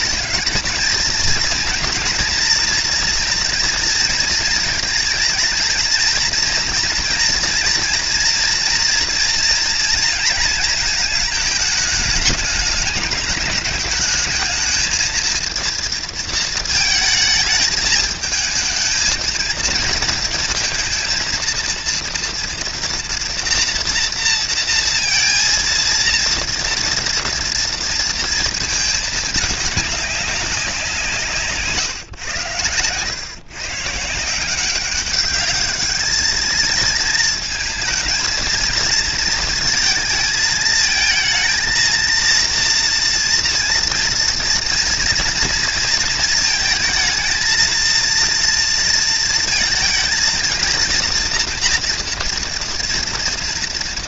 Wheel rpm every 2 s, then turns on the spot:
230, 230, 230, 230, 240, 220, 210, 220, 230, 230, 230, 230, 230, 230, 220, 170, 110, 190, 230, 230, 220, 230, 230, 220, 230, 230, 230.
none